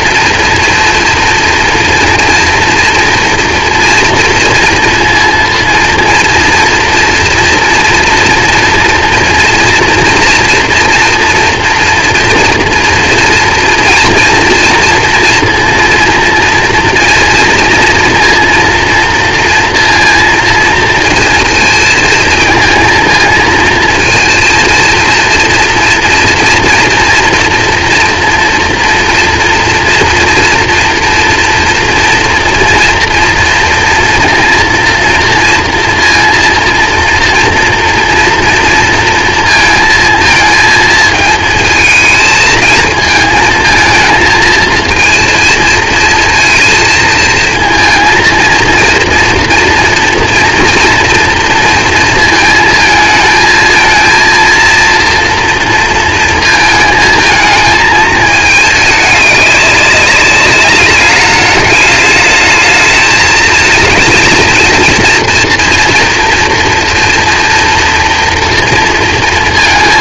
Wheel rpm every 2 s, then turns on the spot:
230, 230, 230, 230, 240, 230, 230, 240, 230, 230, 230, 230, 230, 240, 240, 230, 230, 230, 230, 230, 220, 220, 230, 230, 230, 230, 230, 230, 230, 220, 200, 210, 220, 230, 240.
none